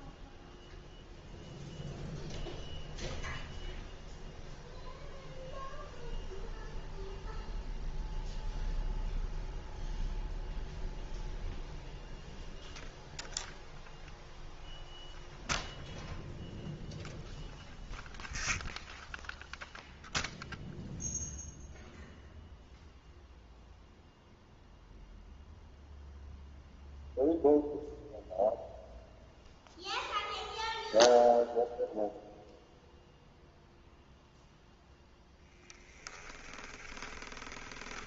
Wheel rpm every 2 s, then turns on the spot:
0, 0, 0, 0, 0, 0, 0, 0, 0, 10, 0, 0, 0, 0, 0, 0, 0, 0, 20.
36-38